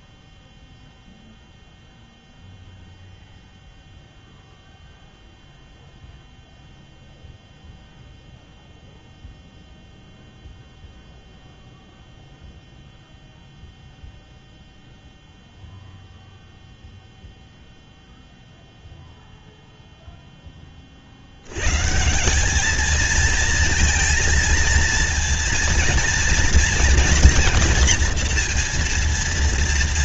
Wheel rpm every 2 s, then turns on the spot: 0, 0, 0, 0, 0, 0, 0, 0, 0, 0, 20, 210, 230, 230, 230.
none